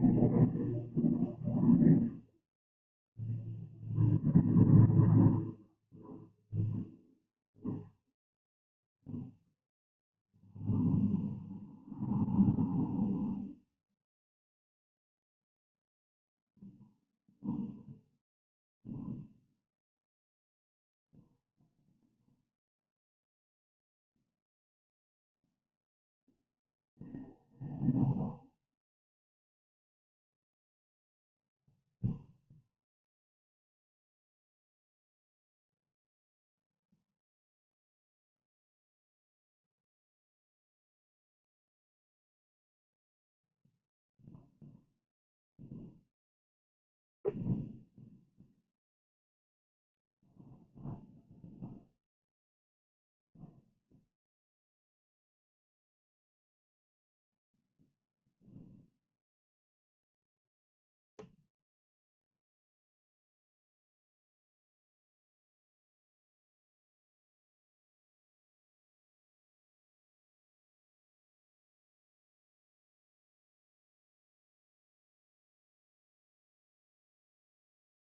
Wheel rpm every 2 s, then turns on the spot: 0, 0, 0, 0, 0, 0, 0, 0, 0, 0, 0, 0, 0, 0, 0, 0, 0, 0, 0, 0, 0, 0, 0, 0, 0, 0, 0, 0, 0, 0, 0, 0, 0, 0, 0, 0, 0, 0, 0.
none